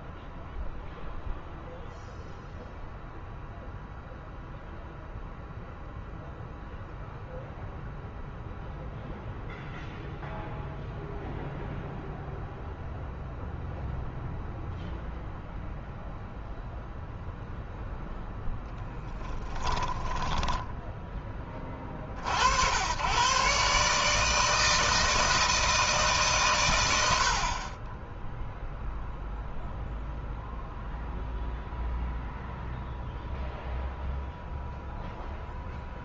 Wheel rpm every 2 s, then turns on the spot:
0, 0, 0, 0, 0, 0, 0, 0, 0, 10, 10, 80, 160, 130, 0, 0, 0, 0.
20-22